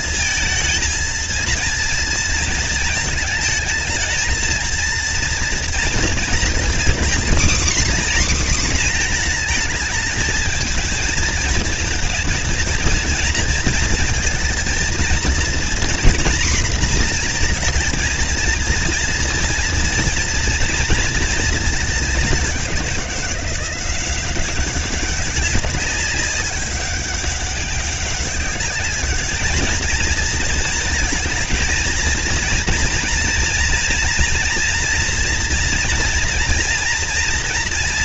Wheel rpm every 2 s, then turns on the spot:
220, 230, 220, 240, 260, 220, 230, 230, 240, 230, 230, 200, 190, 200, 200, 230, 230, 230, 230.
none